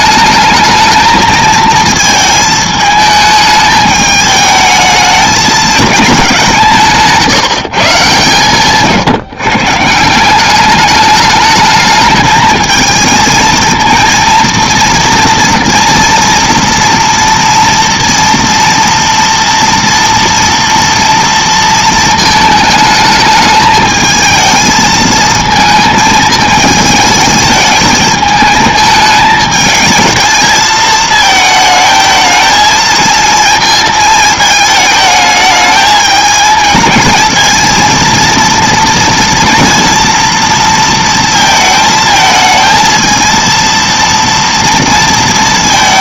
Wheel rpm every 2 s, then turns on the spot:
220, 220, 220, 190, 140, 200, 220, 230, 230, 230, 230, 220, 220, 220, 220, 220, 220, 220, 220, 230, 230, 220, 230.
none